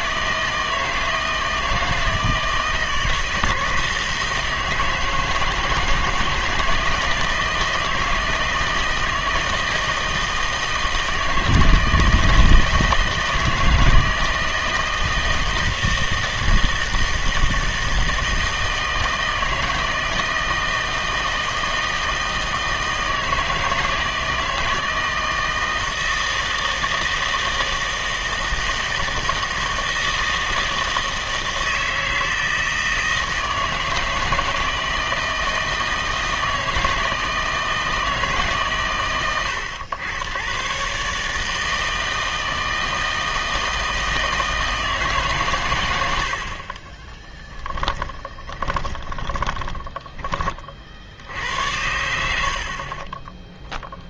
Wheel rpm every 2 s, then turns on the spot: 160, 160, 160, 160, 160, 160, 160, 160, 160, 160, 160, 160, 160, 160, 160, 160, 160, 160, 160, 130, 110, 160, 160, 50, 20, 30, 70.
46-50